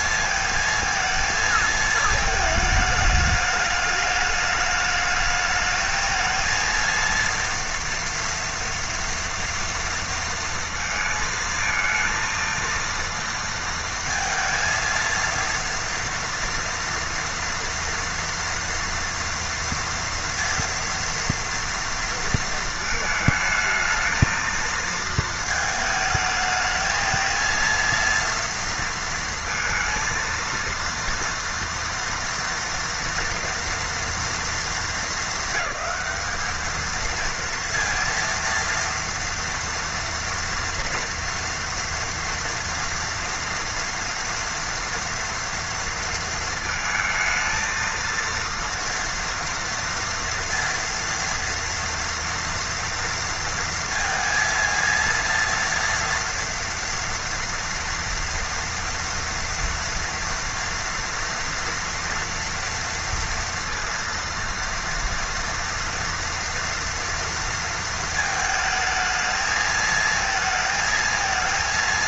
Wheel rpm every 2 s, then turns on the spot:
230, 210, 210, 230, 230, 230, 230, 230, 230, 230, 230, 220, 220, 220, 230, 230, 230, 200, 220, 230, 230, 230, 230, 230, 230, 230, 230, 230, 230, 230, 230, 230, 230, 230, 220, 220.
none